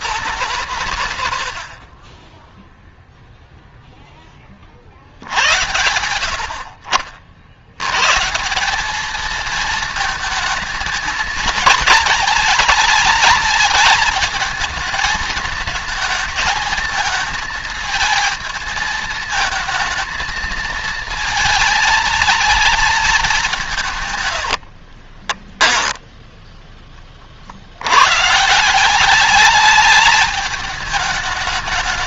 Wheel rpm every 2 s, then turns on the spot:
110, 0, 60, 70, 190, 220, 210, 220, 220, 220, 230, 220, 40, 10, 160, 210.
24-26